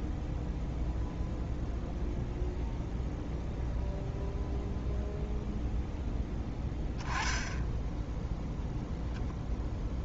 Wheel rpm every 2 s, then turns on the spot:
0, 0, 0, 10, 0.
none